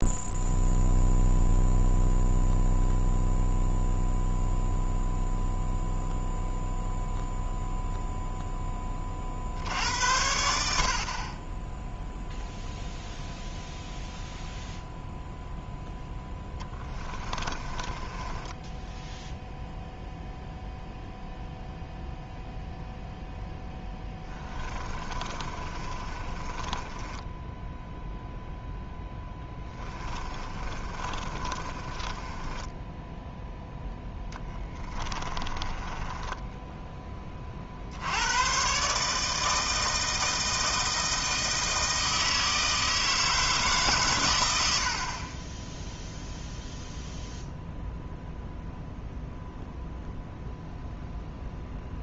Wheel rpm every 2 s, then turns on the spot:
0, 0, 0, 0, 20, 60, 0, 0, 10, 10, 0, 0, 20, 20, 10, 30, 10, 20, 10, 120, 160, 160, 70, 0, 0, 0.
16-20 24-28 30-36